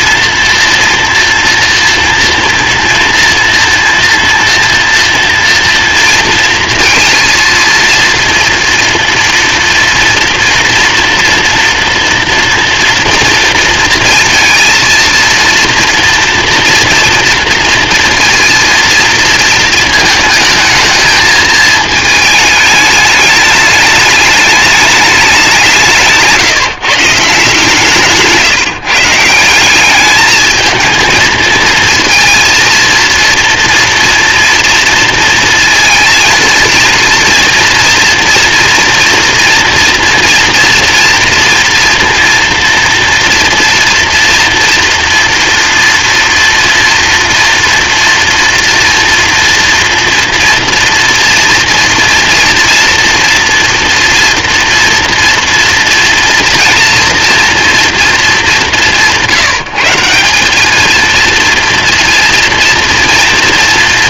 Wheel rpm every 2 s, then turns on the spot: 240, 230, 240, 230, 230, 230, 230, 230, 230, 230, 220, 220, 210, 180, 150, 190, 220, 230, 230, 230, 230, 230, 230, 230, 230, 230, 230, 240, 230, 230, 160, 230.
none